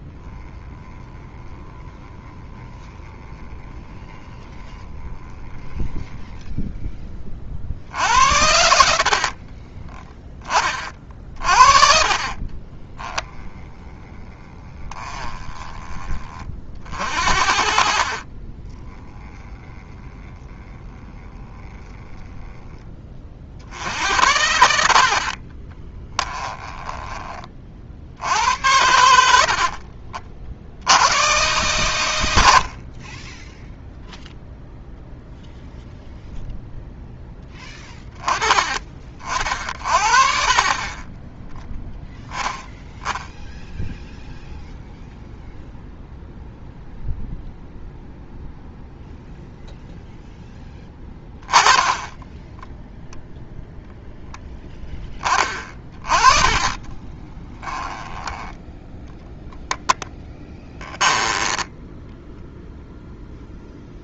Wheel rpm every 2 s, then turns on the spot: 10, 10, 10, 10, 70, 40, 20, 20, 50, 20, 10, 10, 90, 10, 80, 80, 40, 0, 0, 30, 40, 10, 0, 0, 0, 10, 0, 10, 20, 10, 10, 0.
8-10 12-16 18-20 26-28 40-42 56-58 60-62